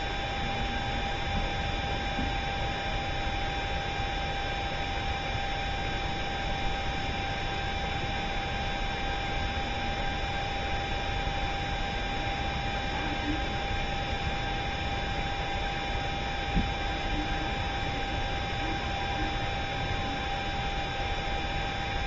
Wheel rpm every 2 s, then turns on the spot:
0, 0, 0, 0, 0, 0, 0, 0, 0, 0, 0.
none